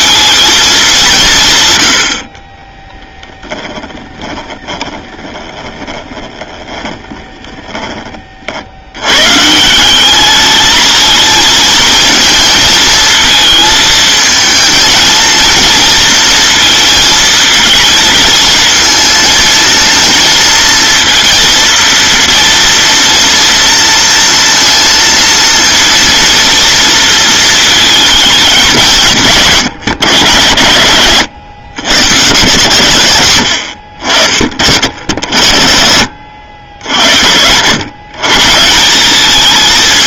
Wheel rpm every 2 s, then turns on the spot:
210, 30, 20, 20, 70, 220, 220, 220, 230, 230, 230, 230, 230, 230, 200, 100, 140, 50, 80, 180.
2-8